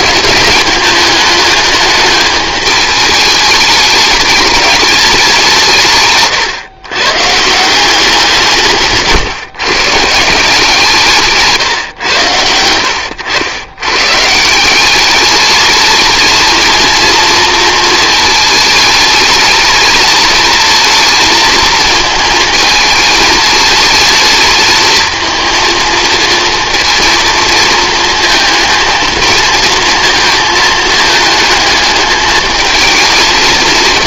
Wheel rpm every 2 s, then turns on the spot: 210, 210, 210, 130, 160, 160, 90, 190, 220, 220, 230, 220, 220, 230, 230, 220, 230.
12-14